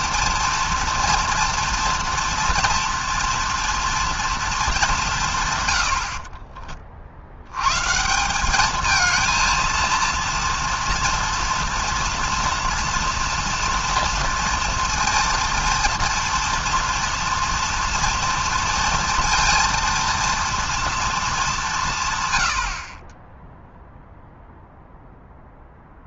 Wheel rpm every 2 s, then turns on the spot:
230, 230, 210, 40, 210, 230, 230, 230, 230, 230, 230, 60, 0.
none